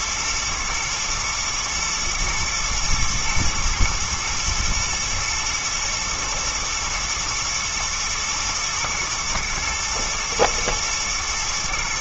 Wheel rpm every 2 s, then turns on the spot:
110, 110, 110, 120, 110, 120.
none